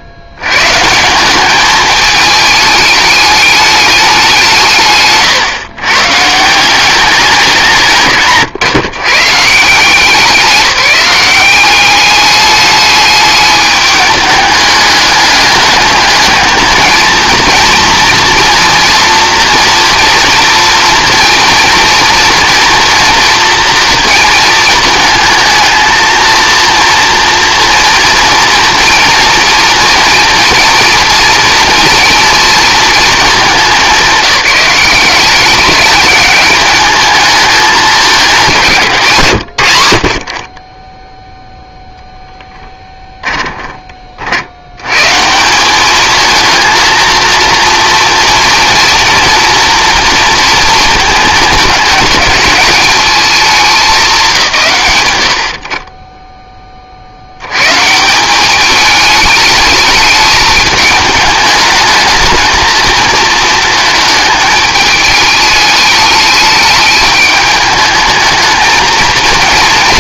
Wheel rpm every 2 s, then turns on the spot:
130, 210, 180, 150, 140, 190, 210, 210, 220, 230, 230, 230, 220, 230, 230, 230, 230, 180, 210, 160, 20, 10, 100, 230, 230, 230, 200, 140, 30, 200, 210, 220, 220, 210, 220.
42-44